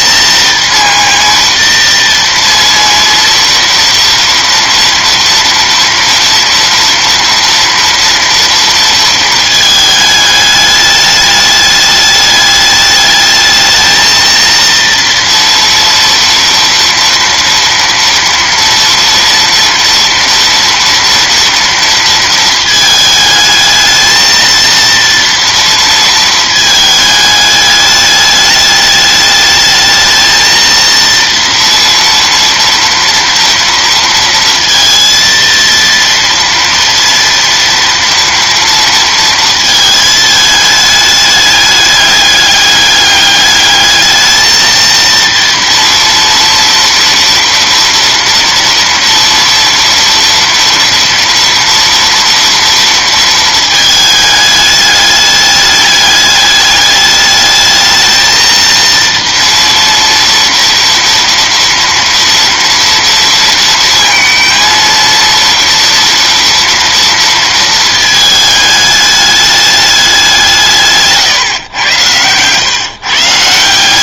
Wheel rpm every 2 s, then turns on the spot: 230, 230, 230, 240, 230, 210, 210, 230, 230, 230, 230, 220, 230, 220, 210, 230, 230, 230, 230, 230, 220, 210, 220, 230, 230, 230, 230, 210, 210, 230, 230, 230, 230, 240, 220, 180, 130.
none